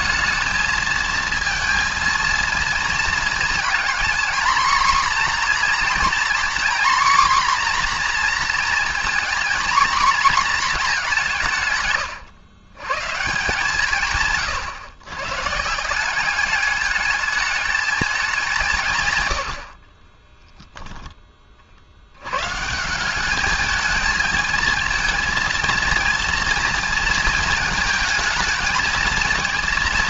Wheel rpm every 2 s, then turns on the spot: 220, 230, 240, 250, 230, 230, 130, 130, 210, 160, 0, 160, 220, 230, 230.
none